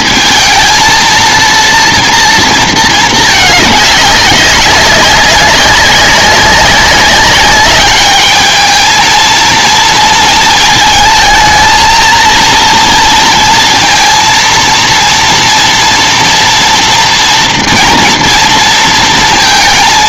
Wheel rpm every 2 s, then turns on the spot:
230, 230, 190, 200, 220, 220, 230, 230, 230, 230.
none